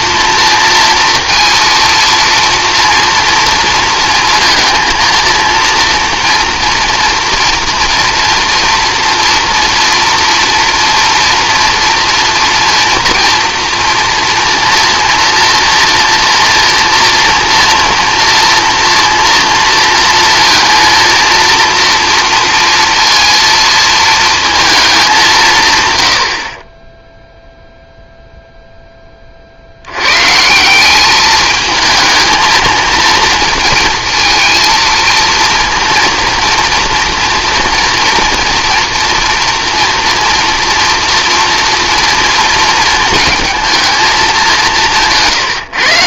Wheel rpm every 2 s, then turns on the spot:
230, 230, 230, 240, 230, 230, 230, 230, 230, 230, 230, 230, 210, 20, 10, 180, 220, 230, 230, 240, 240, 230, 170.
none